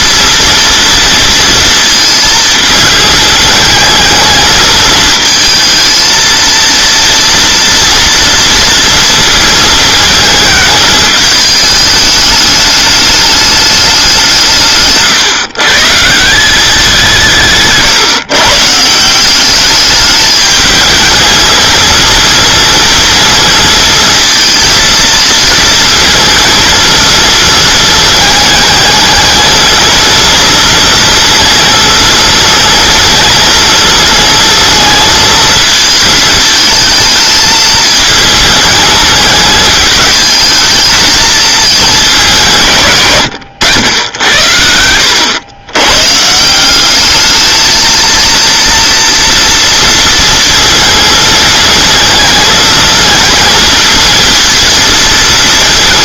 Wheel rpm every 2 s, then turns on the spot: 230, 220, 220, 230, 230, 220, 210, 150, 180, 160, 210, 230, 230, 220, 220, 230, 220, 220, 220, 220, 220, 140, 80, 180, 230, 230, 220, 230.
none